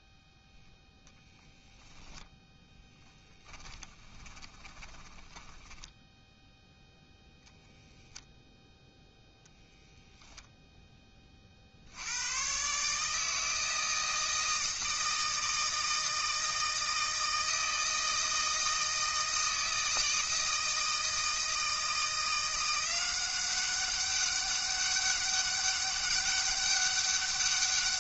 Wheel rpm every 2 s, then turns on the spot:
0, 10, 20, 0, 0, 0, 110, 160, 160, 160, 160, 170, 200, 200.
4-6